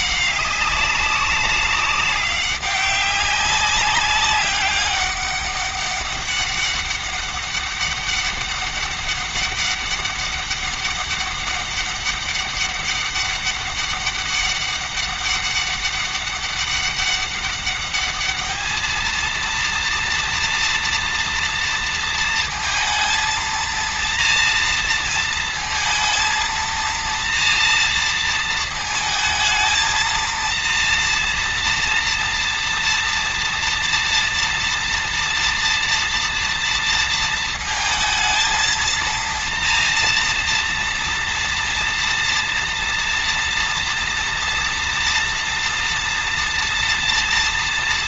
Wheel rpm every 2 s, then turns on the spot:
190, 200, 200, 200, 200, 200, 200, 200, 200, 220, 230, 230, 230, 230, 220, 230, 230, 230, 230, 230, 230, 230, 230, 230.
none